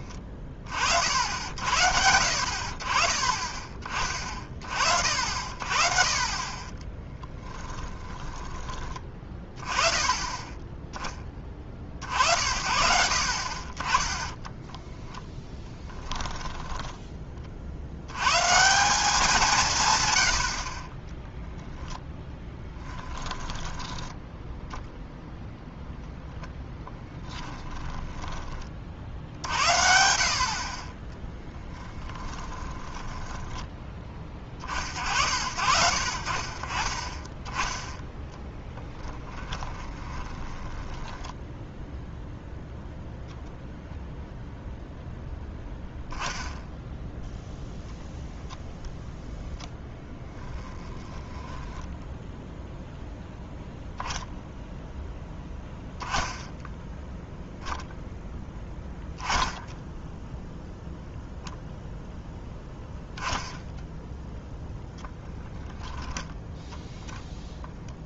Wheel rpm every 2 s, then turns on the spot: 40, 40, 50, 20, 20, 20, 70, 10, 10, 170, 40, 10, 0, 20, 40, 30, 20, 40, 40, 10, 10, 0, 0, 0, 0, 10, 0, 0, 0, 10, 0, 0, 0, 0.
6-8 14-18 22-24 32-34 38-42 50-52